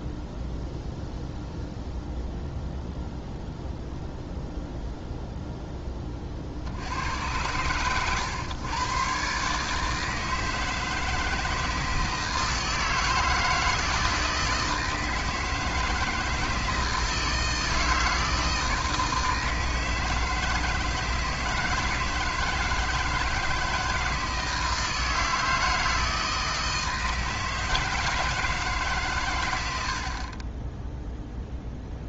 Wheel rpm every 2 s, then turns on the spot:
0, 0, 0, 60, 120, 160, 160, 160, 160, 160, 160, 160, 160, 160, 160, 10.
none